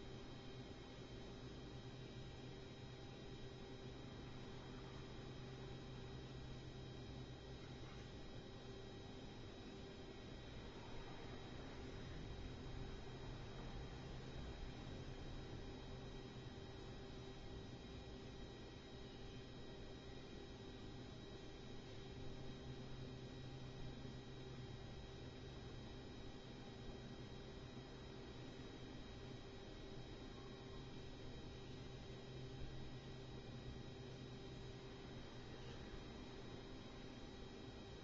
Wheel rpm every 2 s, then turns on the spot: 0, 0, 0, 0, 0, 0, 0, 0, 0, 0, 0, 0, 0, 0, 0, 0, 0, 0, 0.
none